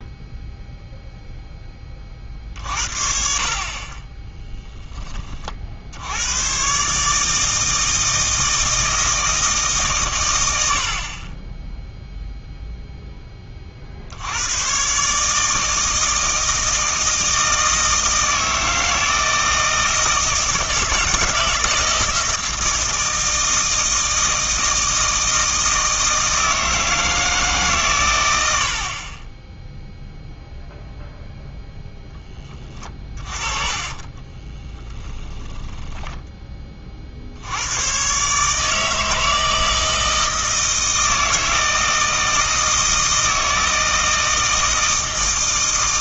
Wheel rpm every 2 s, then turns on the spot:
0, 60, 10, 130, 160, 60, 0, 130, 160, 160, 160, 160, 160, 160, 60, 0, 20, 20, 30, 150, 160, 160, 160.
32-36